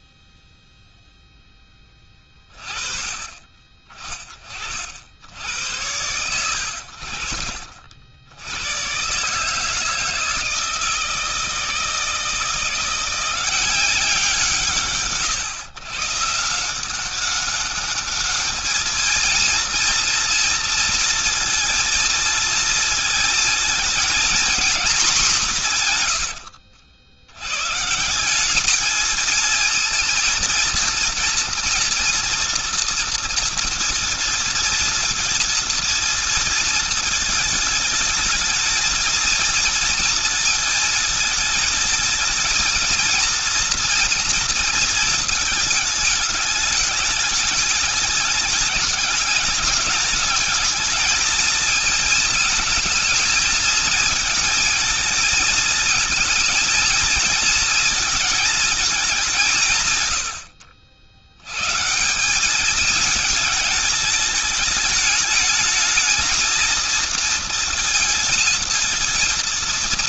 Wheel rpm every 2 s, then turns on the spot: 0, 30, 50, 80, 130, 160, 170, 160, 180, 220, 230, 220, 220, 100, 220, 230, 230, 230, 220, 220, 220, 220, 220, 210, 210, 220, 220, 220, 230, 200, 70, 210, 220, 230, 230.
none